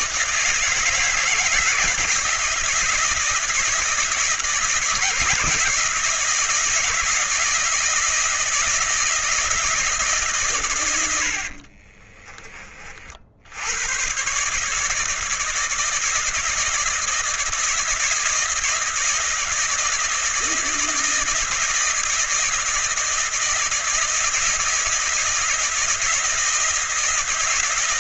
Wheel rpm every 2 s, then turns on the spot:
160, 160, 160, 160, 160, 100, 50, 150, 160, 160, 160, 160, 170, 170.
none